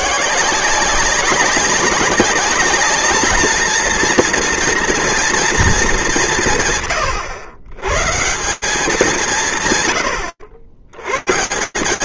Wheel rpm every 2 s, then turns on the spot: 170, 200, 230, 150, 180, 90.
none